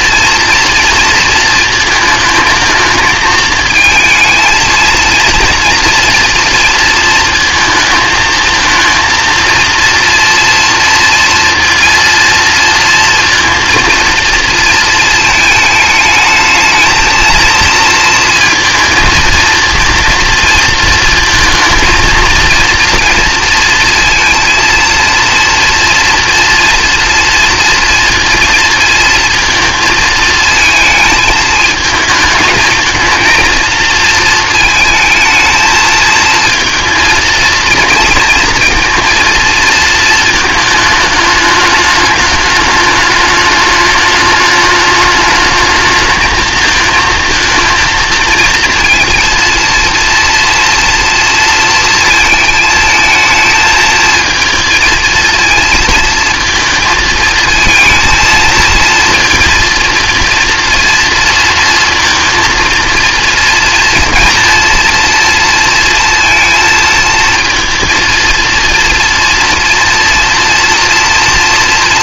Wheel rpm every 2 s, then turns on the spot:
230, 220, 230, 230, 220, 230, 230, 230, 220, 230, 230, 230, 230, 230, 230, 220, 220, 220, 230, 230, 220, 210, 210, 220, 230, 230, 220, 220, 220, 230, 230, 230, 230, 230, 230, 230.
none